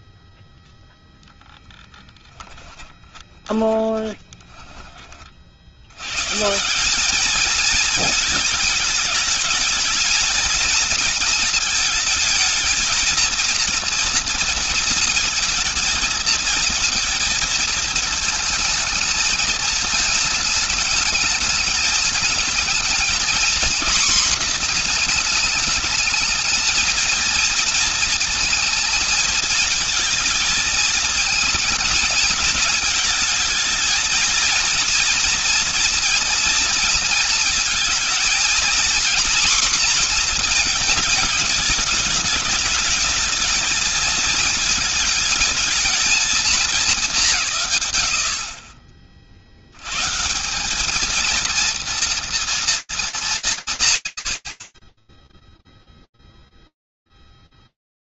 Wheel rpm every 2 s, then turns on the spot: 0, 20, 70, 220, 210, 220, 230, 230, 230, 220, 210, 240, 210, 230, 230, 220, 220, 230, 220, 240, 210, 220, 220, 150, 50, 230, 180, 0, 0.
2-4